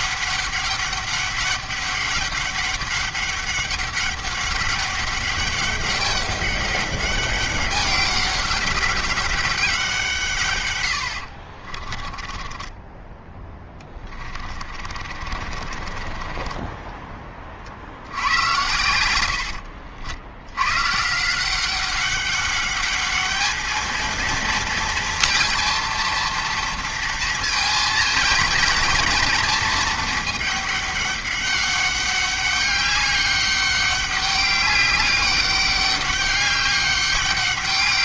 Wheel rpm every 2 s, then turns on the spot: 200, 200, 200, 200, 200, 100, 10, 40, 20, 90, 110, 200, 230, 230, 230, 210, 200, 200, 200.
12-18